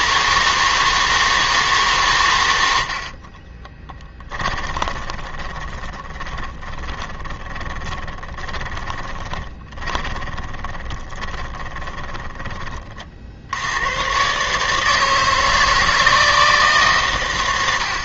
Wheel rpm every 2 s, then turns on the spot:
160, 80, 20, 20, 20, 10, 30, 150, 140.
4-12